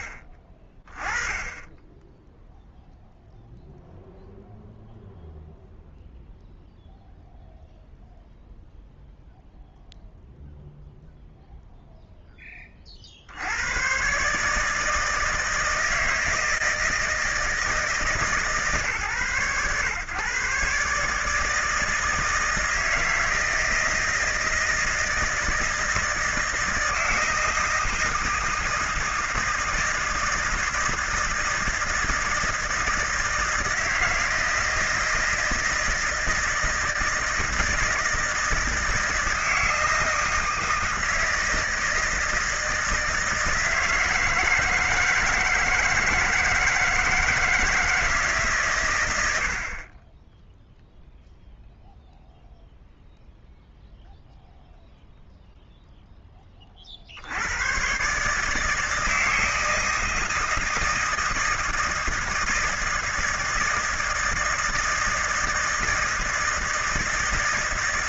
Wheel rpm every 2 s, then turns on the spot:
20, 0, 0, 0, 0, 0, 40, 160, 160, 140, 150, 160, 160, 160, 160, 160, 160, 160, 160, 160, 160, 160, 160, 160, 110, 0, 0, 0, 50, 160, 160, 160, 160, 160.
none